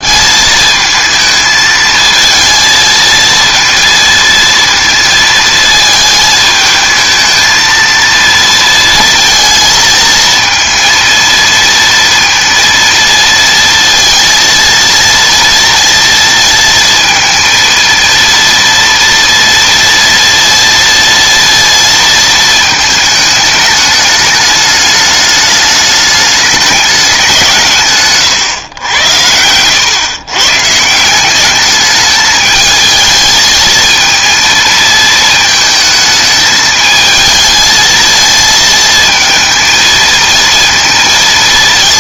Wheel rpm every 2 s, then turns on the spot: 220, 220, 230, 220, 230, 230, 230, 230, 230, 230, 230, 220, 210, 210, 110, 150, 220, 220, 220, 230, 230.
none